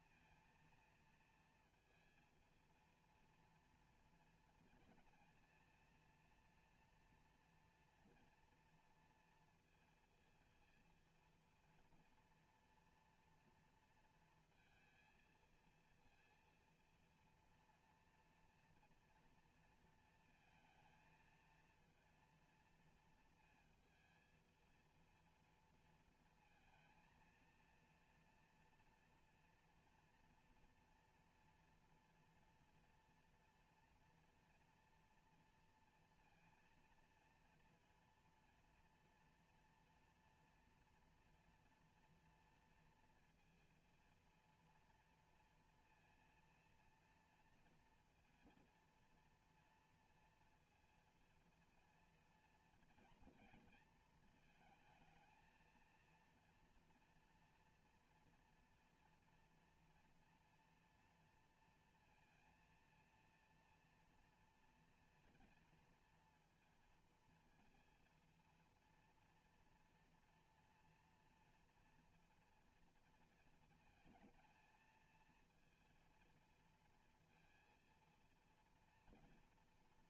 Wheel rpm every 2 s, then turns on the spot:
230, 230, 230, 230, 230, 230, 240, 230, 230, 230, 230, 230, 230, 230, 230, 230, 230, 230, 230, 230, 240, 230, 230, 230, 230, 230, 230, 220, 240, 230, 230, 230, 240, 230, 230, 230, 230, 220, 230, 230.
none